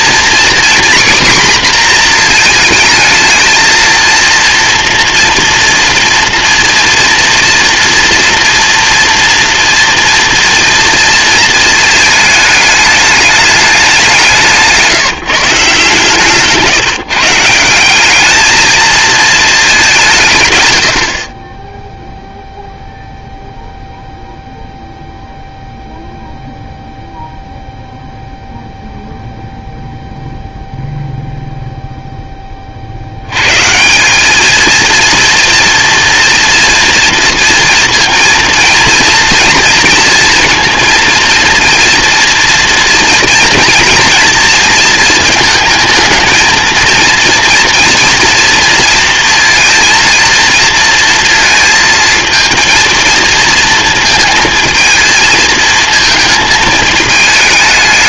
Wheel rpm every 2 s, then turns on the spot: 250, 230, 230, 240, 240, 230, 220, 160, 150, 220, 110, 0, 0, 0, 0, 0, 10, 200, 230, 230, 230, 240, 230, 230, 240, 230, 230, 220, 220.
14-16